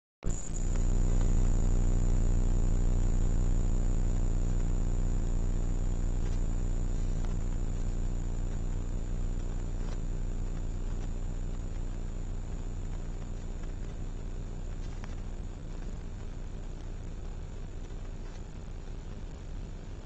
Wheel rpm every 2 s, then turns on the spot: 0, 0, 0, 0, 0, 0, 0, 0, 0, 0.
none